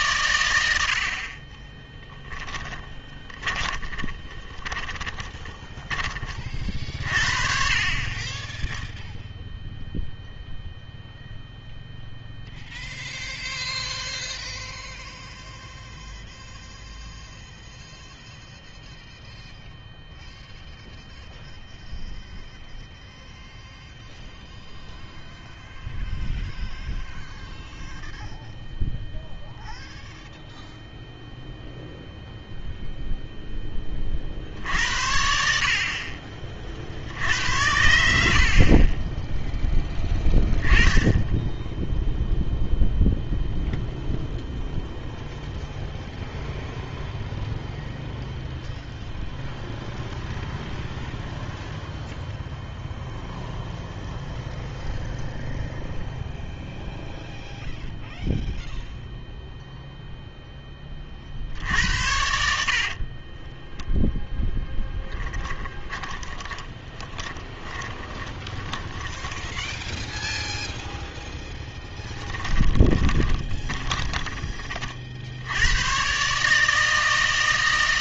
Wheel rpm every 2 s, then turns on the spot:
90, 20, 20, 40, 10, 0, 0, 0, 0, 0, 0, 0, 0, 0, 0, 0, 0, 70, 60, 30, 10, 0, 0, 0, 0, 0, 0, 0, 0, 0, 20, 60, 10, 20, 10, 0, 20, 30, 150.
2-6 64-70 72-74